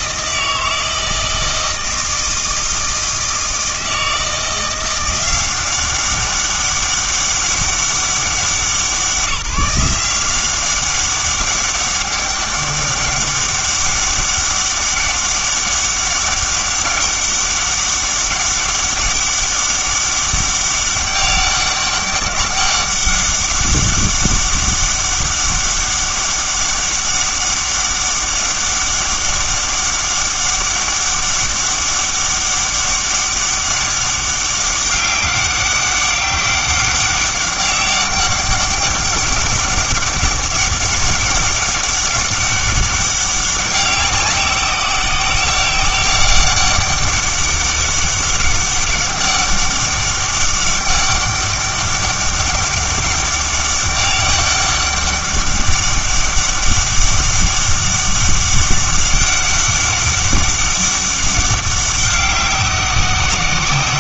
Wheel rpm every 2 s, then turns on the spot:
160, 160, 170, 200, 170, 190, 200, 200, 200, 200, 200, 200, 200, 200, 200, 200, 200, 200, 200, 200, 200, 200, 190, 190, 200, 200, 200, 200, 200, 200, 200, 190.
none